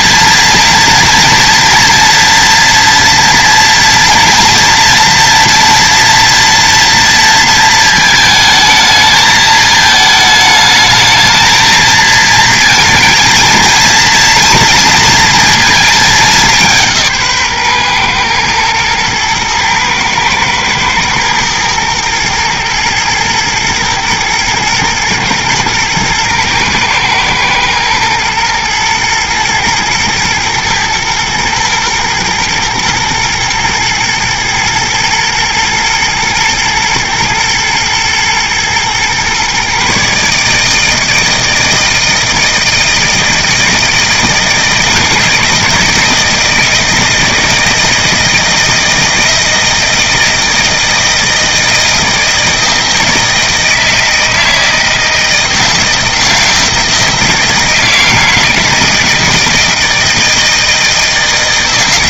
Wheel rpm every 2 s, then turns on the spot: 230, 230, 230, 230, 220, 220, 230, 230, 170, 110, 110, 110, 110, 110, 110, 110, 120, 110, 110, 120, 160, 160, 160, 160, 160, 160, 160, 160, 160, 160, 160.
none